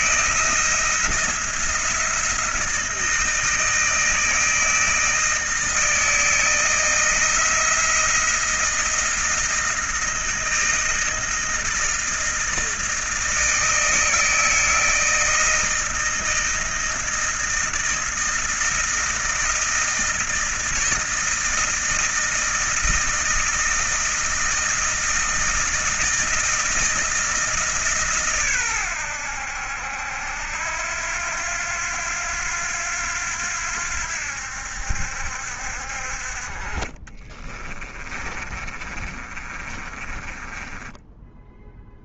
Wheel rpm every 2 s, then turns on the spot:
160, 160, 160, 160, 170, 160, 160, 160, 160, 160, 160, 160, 160, 160, 140, 80, 90, 80, 50, 30, 30.
38-42